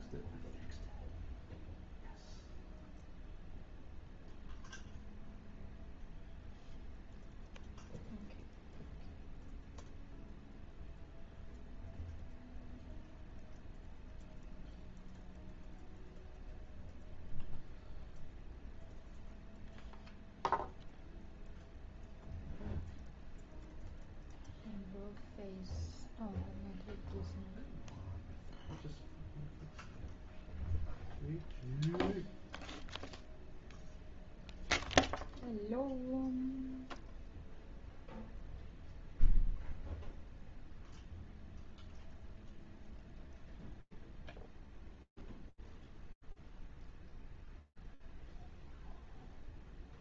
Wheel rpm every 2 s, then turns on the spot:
0, 0, 0, 0, 0, 0, 0, 0, 0, 0, 0, 0, 0, 0, 0, 0, 0, 0, 0, 0, 0, 0, 0, 0, 0.
none